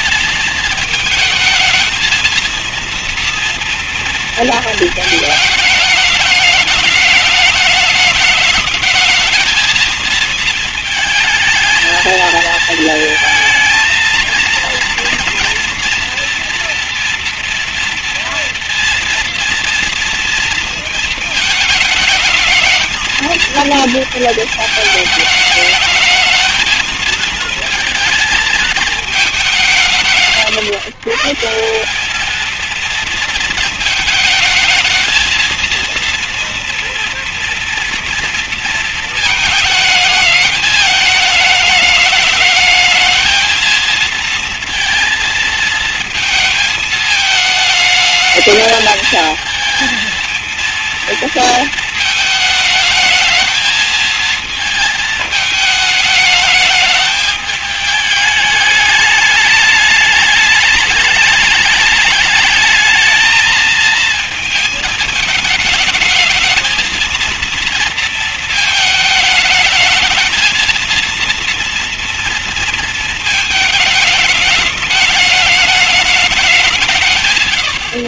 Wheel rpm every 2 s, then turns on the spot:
220, 230, 230, 210, 210, 220, 220, 230, 230, 230, 230, 220, 220, 220, 230, 150, 210, 220, 230, 230, 210, 210, 230, 220, 210, 220, 220, 230, 210, 210, 210, 220, 220, 220, 220, 220, 230, 210, 200.
none